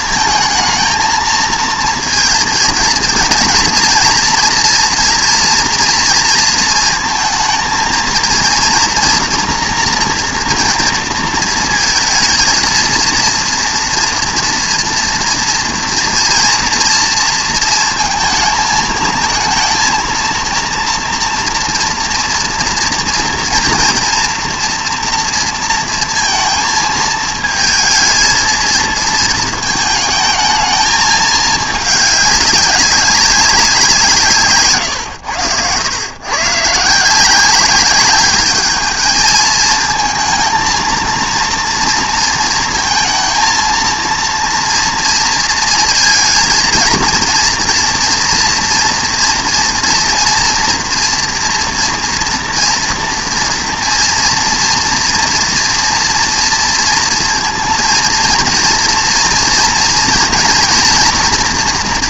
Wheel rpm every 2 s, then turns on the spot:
220, 230, 230, 230, 230, 230, 230, 230, 230, 220, 240, 230, 230, 220, 220, 220, 200, 130, 150, 210, 230, 230, 230, 230, 230, 230, 230, 230, 230, 230, 230.
34-36